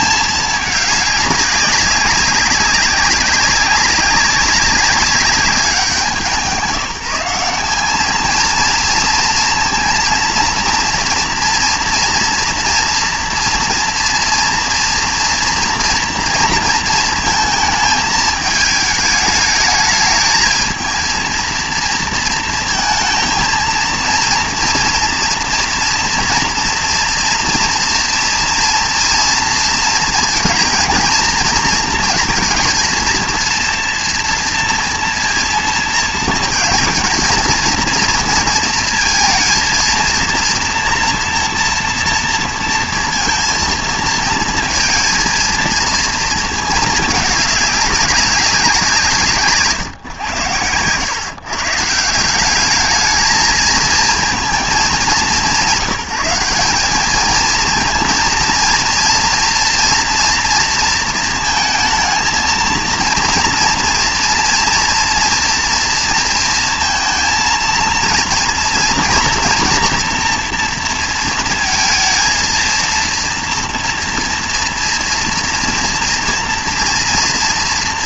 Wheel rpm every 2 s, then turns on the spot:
210, 190, 200, 180, 230, 230, 230, 230, 230, 210, 220, 230, 230, 230, 230, 230, 230, 230, 230, 230, 230, 230, 230, 220, 190, 100, 200, 210, 190, 230, 230, 230, 230, 230, 230, 230, 230, 230, 230.
none